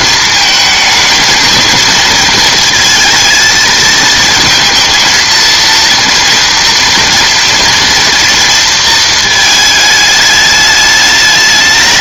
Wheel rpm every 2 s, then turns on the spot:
220, 230, 220, 230, 230, 210.
none